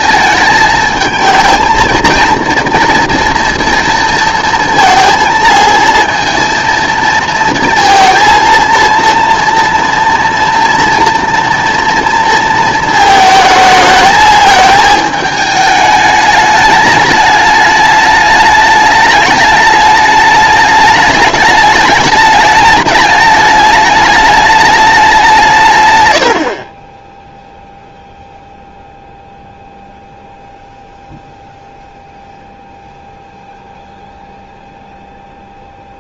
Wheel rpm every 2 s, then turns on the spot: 220, 230, 230, 230, 230, 230, 230, 220, 210, 210, 210, 210, 210, 30, 0, 0, 0, 0.
none